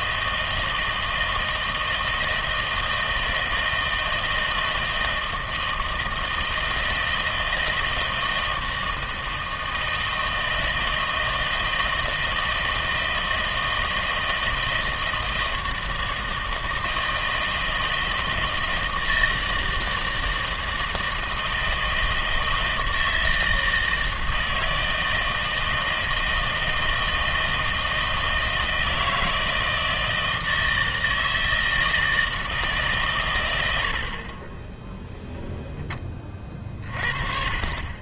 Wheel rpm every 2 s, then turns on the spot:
160, 160, 160, 160, 160, 160, 160, 160, 160, 160, 160, 160, 160, 160, 160, 160, 150, 10, 30.
none